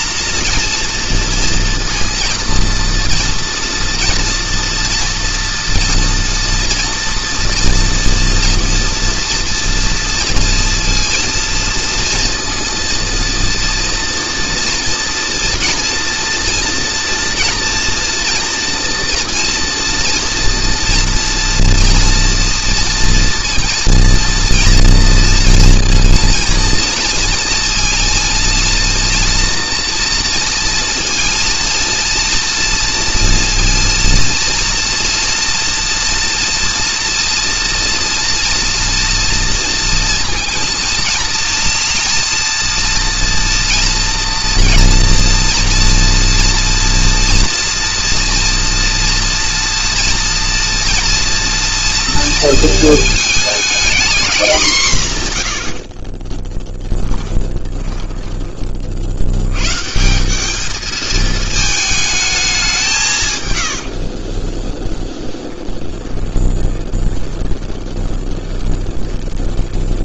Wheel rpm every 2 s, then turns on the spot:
230, 240, 230, 230, 230, 230, 230, 240, 230, 230, 230, 230, 230, 230, 230, 230, 230, 230, 230, 230, 230, 230, 240, 230, 230, 230, 220, 160, 10, 40, 210, 180, 10, 20, 20.
56-58 64-70